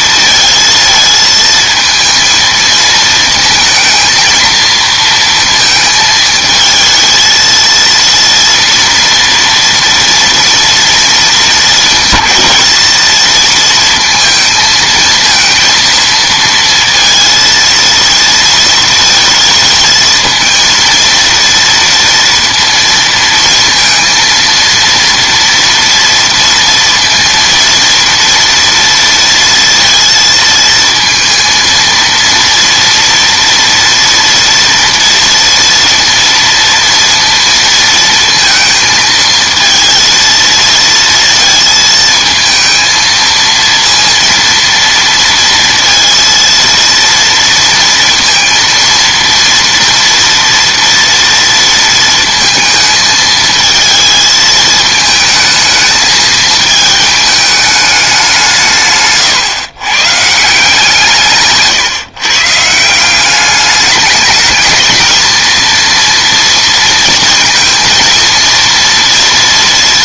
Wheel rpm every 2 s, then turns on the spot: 220, 220, 230, 220, 230, 230, 220, 220, 230, 230, 230, 230, 230, 230, 230, 220, 230, 230, 230, 220, 230, 230, 230, 230, 230, 230, 230, 220, 220, 160, 160, 150, 210, 230, 230.
none